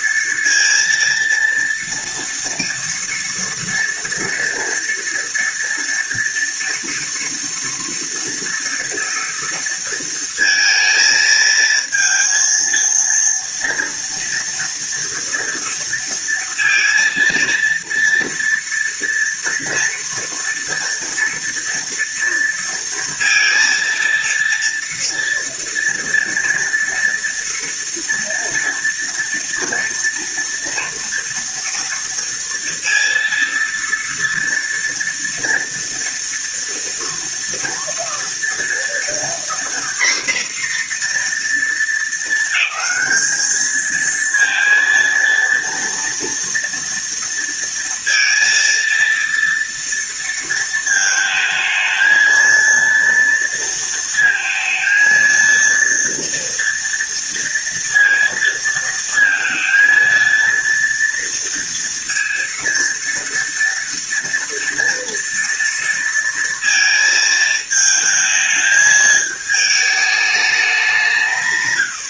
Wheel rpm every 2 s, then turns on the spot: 230, 230, 230, 230, 230, 220, 230, 230, 230, 230, 230, 230, 230, 230, 230, 230, 230, 230, 230, 240, 240, 210, 230, 230, 230, 220, 230, 230, 230, 230, 230, 230, 230, 230, 220, 180.
none